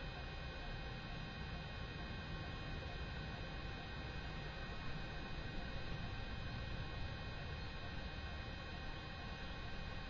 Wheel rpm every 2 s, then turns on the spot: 0, 0, 0, 0, 0.
none